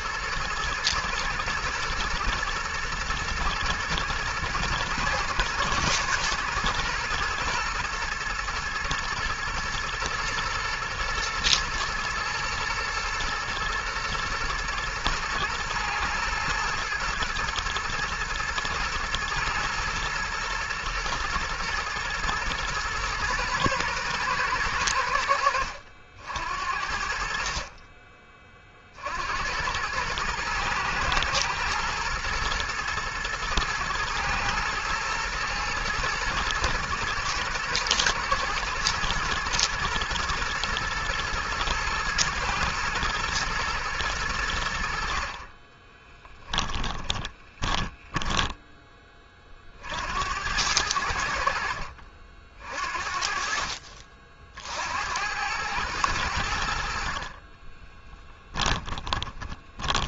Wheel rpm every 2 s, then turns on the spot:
120, 110, 120, 120, 120, 120, 110, 110, 110, 120, 120, 120, 100, 60, 40, 120, 120, 120, 110, 110, 110, 120, 80, 20, 20, 90, 50, 60, 70, 20.
46-50 58-60